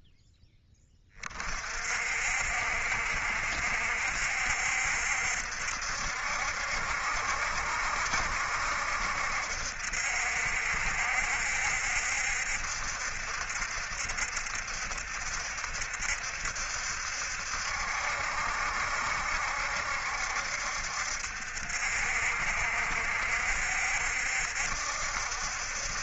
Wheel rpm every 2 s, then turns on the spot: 20, 70, 70, 70, 70, 70, 70, 70, 70, 70, 70, 70, 70.
none